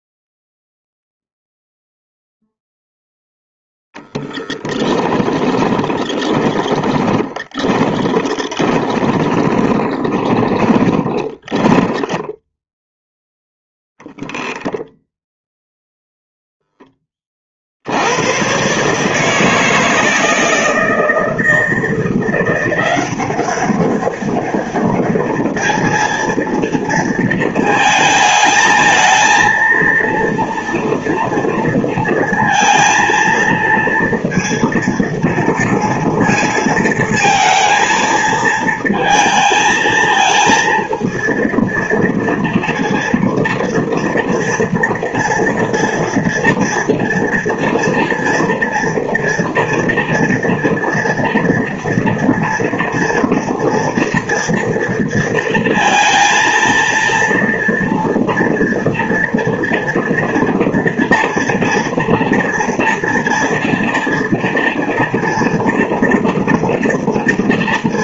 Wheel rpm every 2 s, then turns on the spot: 0, 0, 0, 20, 20, 20, 0, 0, 0, 130, 160, 180, 200, 230, 220, 230, 230, 230, 230, 230, 230, 230, 230, 230, 230, 230, 230, 230, 230, 230, 230, 240, 230, 230.
6-12